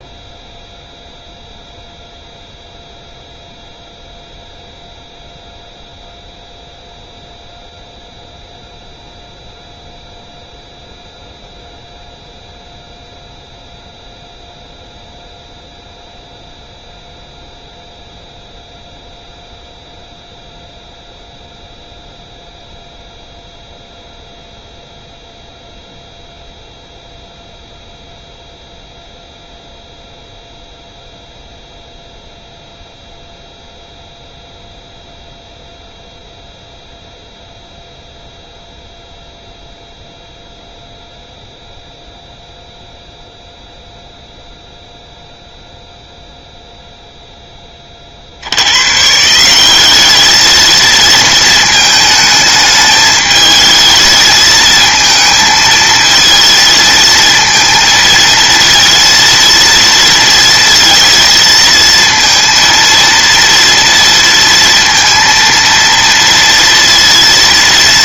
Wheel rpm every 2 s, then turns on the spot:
0, 0, 0, 0, 0, 0, 0, 0, 0, 0, 0, 0, 0, 0, 0, 0, 0, 0, 0, 0, 0, 0, 0, 0, 130, 230, 210, 220, 230, 230, 230, 230, 230, 230.
none